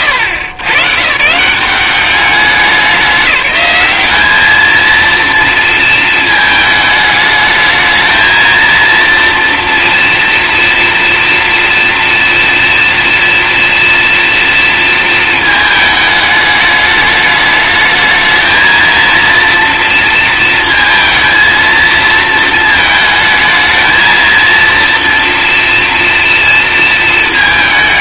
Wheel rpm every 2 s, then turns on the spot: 120, 190, 220, 210, 230, 230, 230, 230, 210, 220, 220, 220, 230, 230.
none